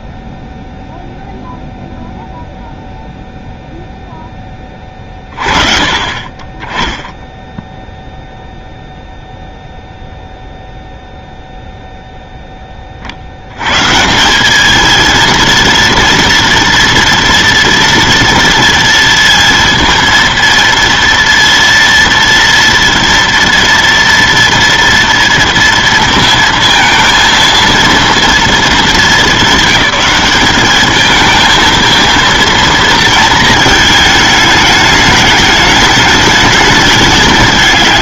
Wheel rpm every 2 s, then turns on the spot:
0, 0, 10, 20, 0, 0, 20, 220, 230, 230, 230, 230, 230, 230, 230, 210, 230, 210, 210.
none